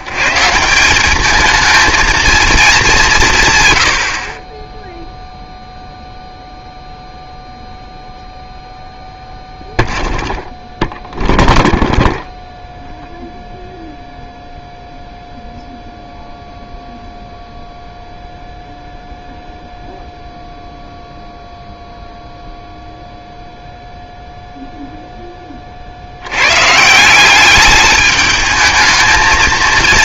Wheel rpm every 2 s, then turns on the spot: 180, 200, 10, 0, 0, 0, 0, 0, 0, 0, 0, 0, 0, 160, 220.
none